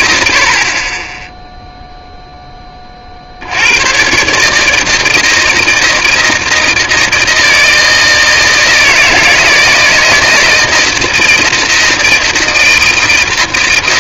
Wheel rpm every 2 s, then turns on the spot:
110, 0, 130, 160, 160, 160, 160.
none